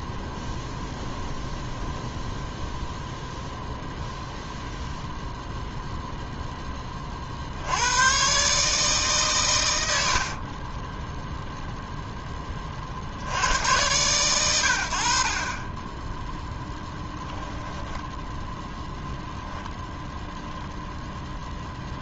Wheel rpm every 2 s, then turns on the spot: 0, 0, 0, 10, 140, 20, 40, 90, 0, 0, 0.
10-12